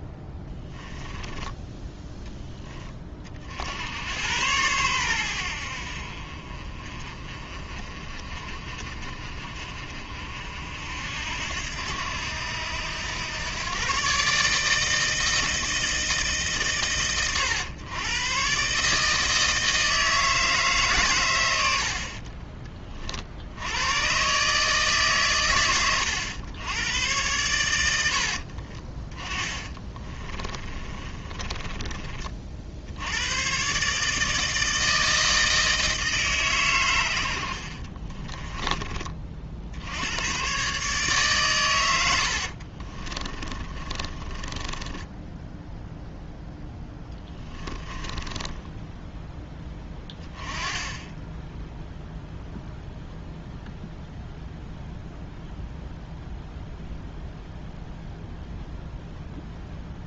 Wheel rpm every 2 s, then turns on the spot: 10, 10, 100, 40, 50, 60, 90, 150, 140, 140, 150, 30, 150, 100, 40, 30, 60, 160, 130, 20, 130, 50, 20, 10, 10, 10, 0, 0, 0, 0.
28-32 42-48